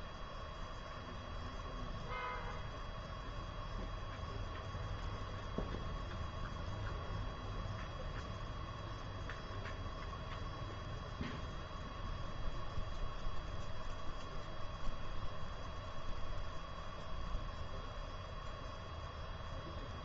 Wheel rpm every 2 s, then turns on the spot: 0, 0, 0, 0, 0, 0, 0, 0, 0, 0.
none